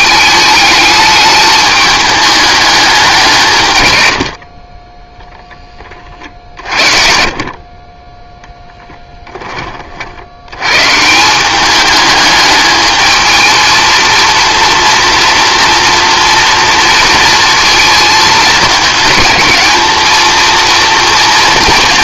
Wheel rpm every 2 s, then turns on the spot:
210, 200, 30, 50, 10, 110, 210, 230, 230, 210, 230.
none